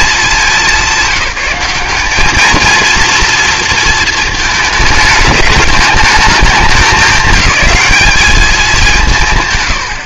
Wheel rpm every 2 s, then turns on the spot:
200, 220, 220, 200, 200.
none